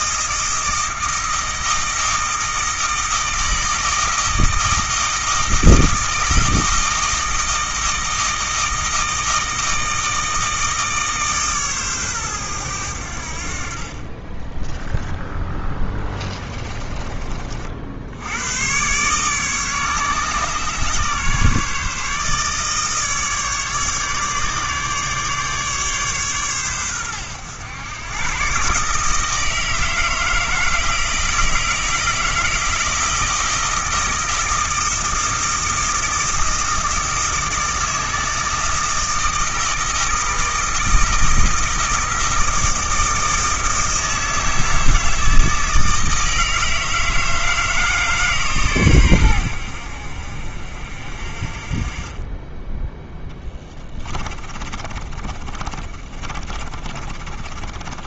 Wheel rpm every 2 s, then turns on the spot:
160, 160, 160, 160, 160, 150, 80, 10, 30, 130, 140, 150, 150, 110, 150, 160, 160, 160, 160, 160, 160, 160, 160, 160, 120, 50, 10, 30, 30.
52-58